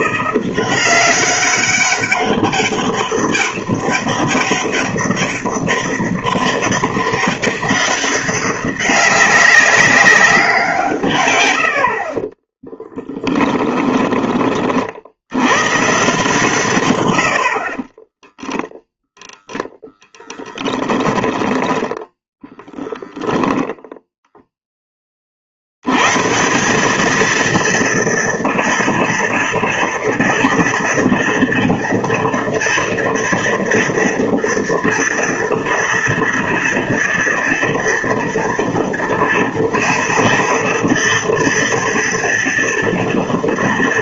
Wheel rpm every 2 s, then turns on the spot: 170, 190, 190, 200, 190, 200, 60, 20, 130, 20, 10, 10, 10, 110, 230, 230, 240, 230, 230, 240, 230, 230.
14-16 20-22